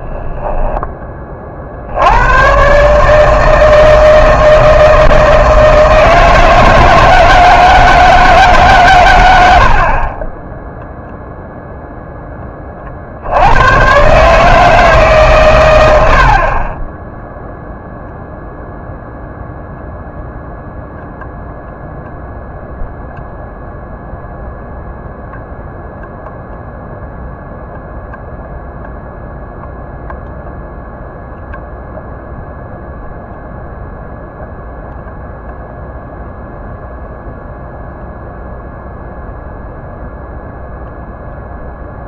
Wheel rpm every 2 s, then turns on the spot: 10, 140, 160, 160, 130, 0, 50, 150, 10, 0, 0, 0, 0, 0, 0, 0, 0, 0, 0, 0, 0.
16-18